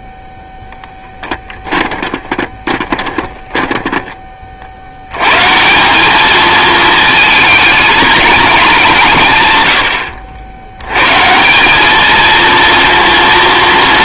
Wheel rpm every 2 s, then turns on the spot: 0, 20, 60, 220, 190, 100, 230.
2-4